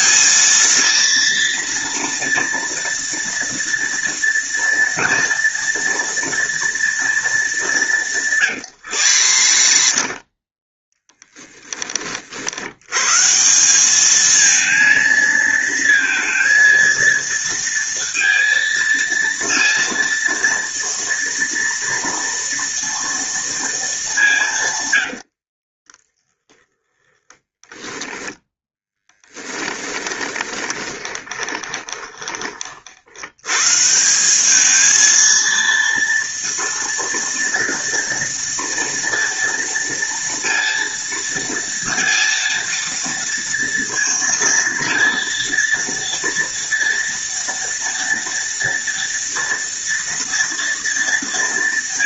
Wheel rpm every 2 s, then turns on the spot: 230, 230, 230, 230, 130, 10, 110, 230, 230, 230, 230, 230, 140, 20, 10, 20, 50, 210, 230, 240, 230, 230, 230, 230, 230, 230.
8-10 26-32